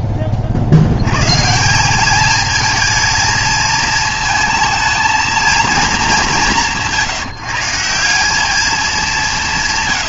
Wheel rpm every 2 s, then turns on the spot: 40, 220, 220, 140, 200.
none